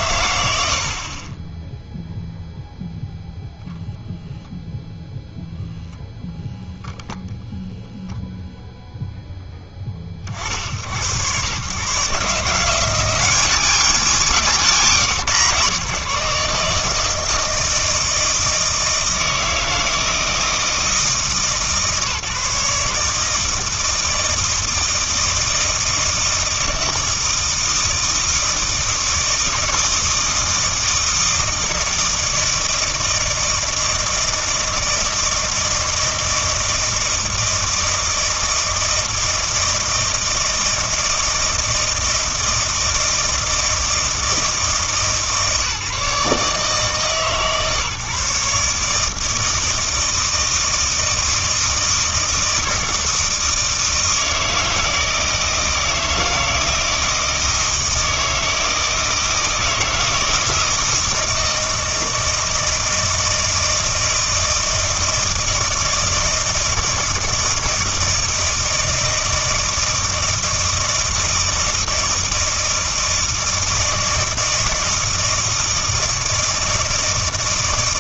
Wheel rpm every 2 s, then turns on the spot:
80, 0, 0, 0, 0, 70, 160, 150, 150, 160, 160, 150, 160, 160, 160, 160, 160, 160, 160, 160, 160, 160, 160, 150, 150, 160, 160, 160, 160, 160, 160, 160, 160, 160, 160, 160, 160, 160, 160.
none